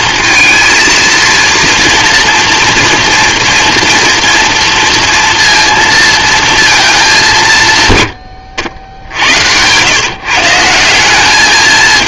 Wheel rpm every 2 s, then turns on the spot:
230, 230, 230, 220, 80, 190.
none